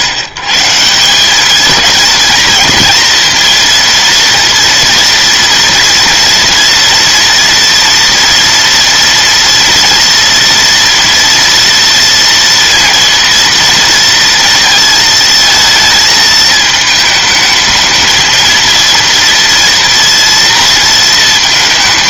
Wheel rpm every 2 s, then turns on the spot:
160, 230, 230, 240, 230, 230, 230, 230, 220, 230, 230.
none